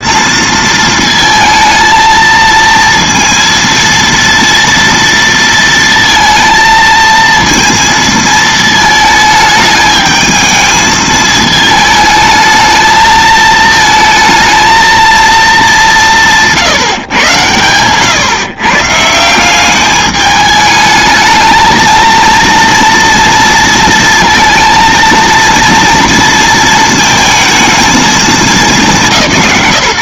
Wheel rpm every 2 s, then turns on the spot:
230, 230, 230, 230, 220, 220, 220, 220, 160, 130, 210, 230, 230, 230, 190.
none